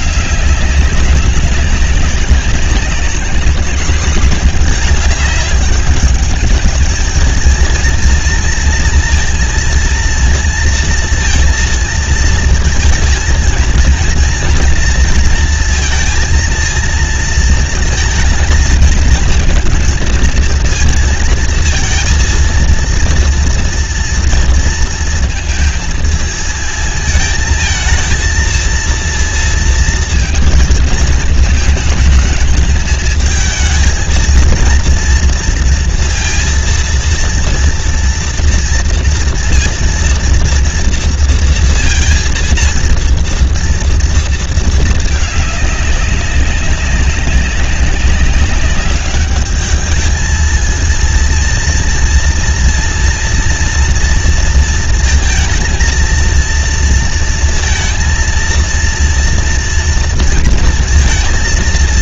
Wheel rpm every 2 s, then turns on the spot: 210, 190, 220, 210, 230, 230, 230, 230, 230, 230, 230, 230, 230, 220, 220, 230, 220, 230, 230, 230, 230, 230, 230, 200, 200, 220, 230, 230, 230, 230, 230.
none